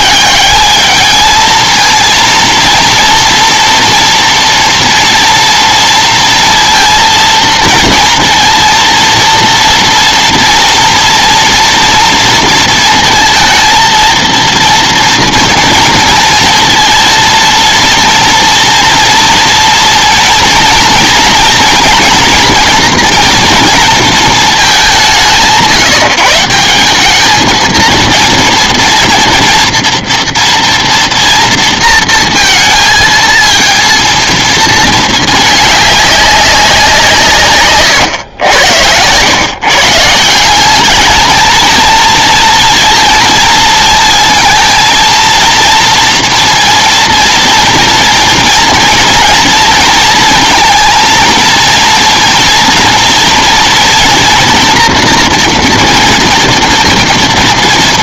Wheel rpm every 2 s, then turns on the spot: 220, 230, 230, 230, 230, 230, 230, 230, 230, 240, 230, 230, 160, 210, 230, 230, 220, 220, 160, 110, 210, 230, 230, 230, 230, 230, 230, 230, 230.
none